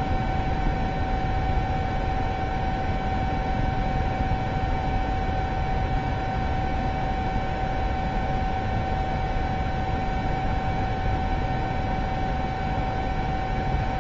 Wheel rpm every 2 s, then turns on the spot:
0, 0, 0, 0, 0, 0, 0.
none